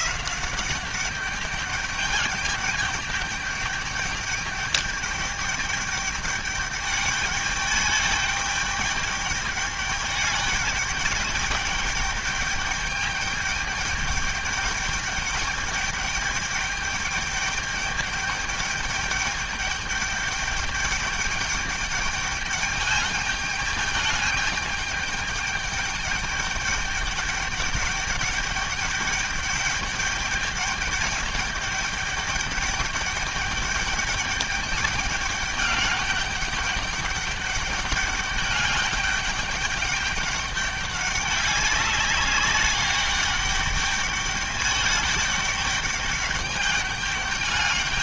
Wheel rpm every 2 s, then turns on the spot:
180, 210, 210, 210, 210, 200, 210, 200, 210, 210, 210, 210, 210, 210, 200, 210, 210, 210, 200, 200, 200, 200, 210, 210.
none